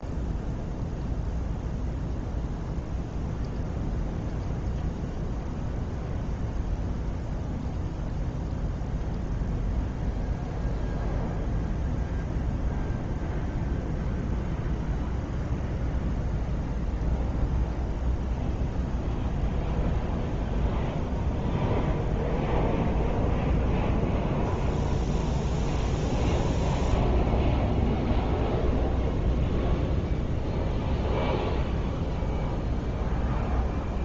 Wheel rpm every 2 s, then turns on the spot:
0, 0, 0, 0, 0, 0, 0, 0, 0, 0, 0, 0, 0, 0, 0, 0, 0.
none